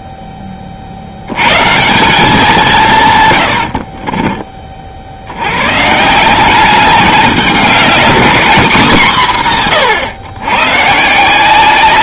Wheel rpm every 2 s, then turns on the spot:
40, 160, 40, 200, 210, 130.
none